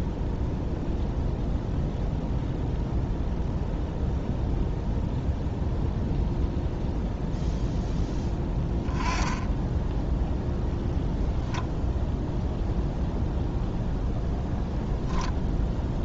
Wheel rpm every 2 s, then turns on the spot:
0, 0, 0, 0, 10, 0, 0, 0.
none